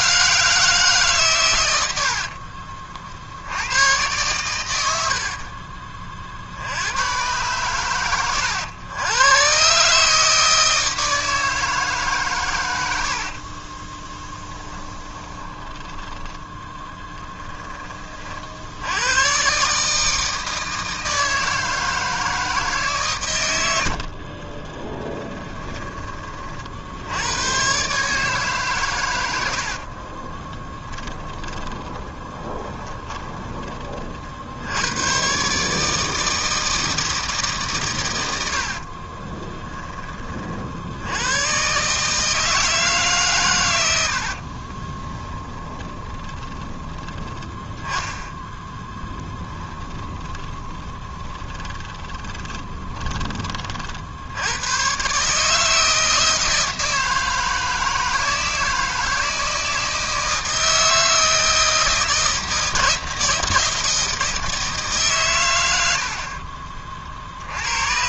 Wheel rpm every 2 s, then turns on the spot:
160, 60, 110, 40, 90, 150, 130, 10, 10, 50, 160, 160, 40, 30, 140, 20, 10, 50, 160, 90, 30, 160, 60, 20, 10, 20, 20, 80, 160, 160, 160, 160, 160, 60.
2-4 14-16 24-26 30-34 44-48 50-54 66-68